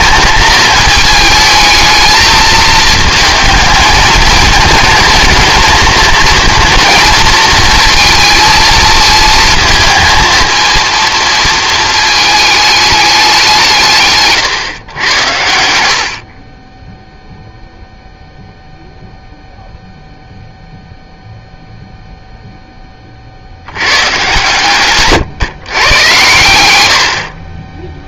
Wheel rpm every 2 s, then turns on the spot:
220, 220, 220, 230, 230, 230, 210, 130, 30, 0, 0, 10, 130, 100.
none